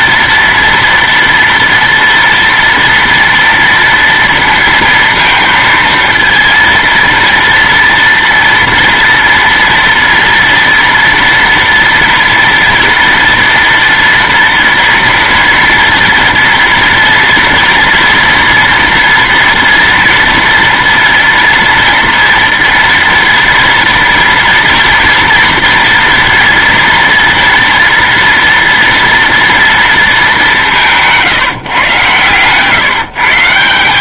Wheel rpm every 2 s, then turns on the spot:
230, 230, 230, 230, 230, 230, 230, 230, 240, 230, 230, 230, 230, 240, 230, 210, 130.
none